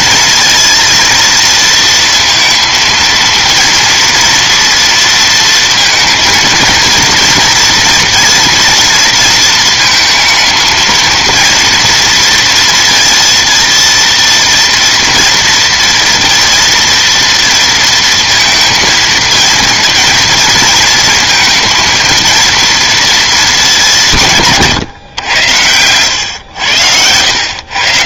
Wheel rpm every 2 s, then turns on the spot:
230, 230, 230, 230, 230, 230, 230, 230, 230, 230, 230, 210, 90, 100.
none